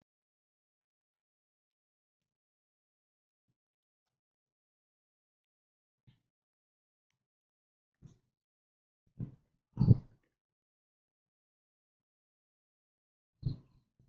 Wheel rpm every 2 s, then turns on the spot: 0, 0, 0, 0, 0, 0, 0.
none